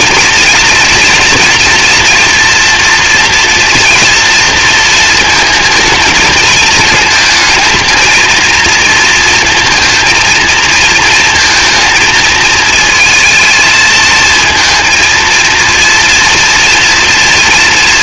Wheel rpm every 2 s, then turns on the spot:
230, 230, 230, 220, 230, 220, 220, 230, 230.
none